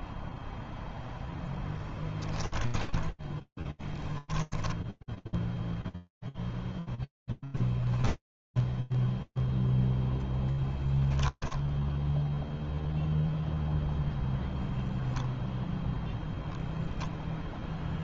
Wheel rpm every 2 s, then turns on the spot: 0, 10, 10, 0, 0, 0, 0, 0, 0.
2-6